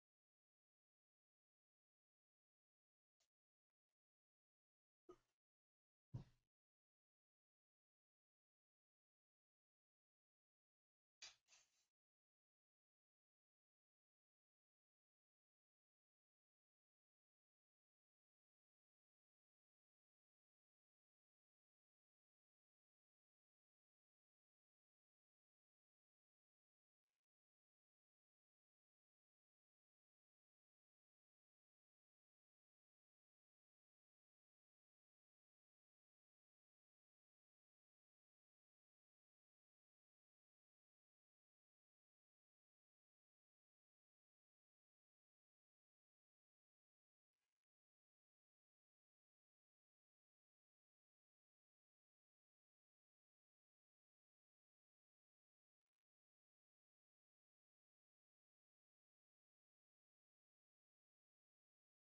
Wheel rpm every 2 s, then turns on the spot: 0, 0, 0, 0, 0, 0, 0, 0, 0, 0, 0, 0, 0, 0, 0, 0, 0, 0, 0, 0, 0, 0, 0, 0, 0, 0, 0, 0, 0, 0, 0.
none